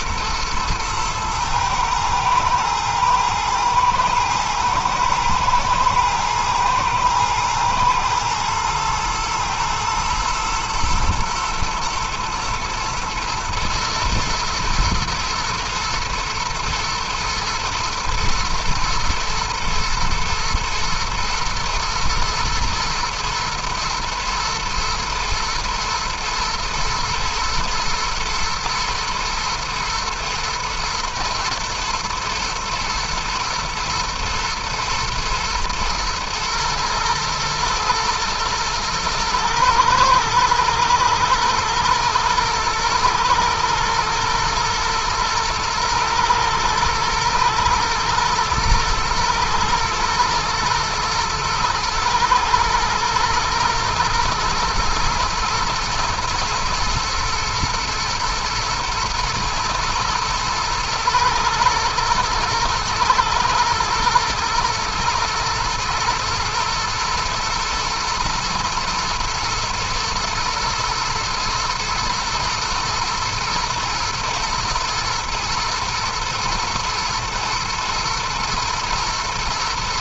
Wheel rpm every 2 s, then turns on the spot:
110, 110, 120, 120, 110, 110, 110, 120, 110, 120, 110, 110, 120, 120, 120, 120, 110, 110, 110, 110, 110, 110, 110, 110, 110, 110, 110, 120, 120, 110, 110, 110, 120, 110, 110, 120, 120, 120, 110, 110.
none